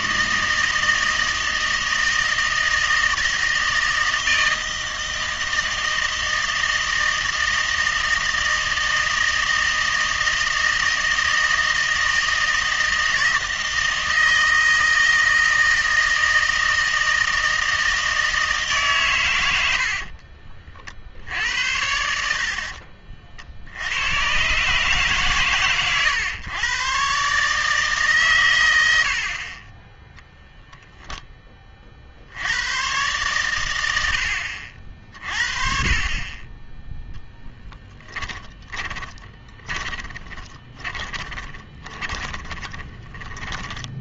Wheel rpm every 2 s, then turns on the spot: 160, 160, 160, 160, 160, 160, 160, 160, 160, 150, 50, 50, 130, 120, 90, 0, 100, 60, 10, 20, 20, 20.
22-24 38-44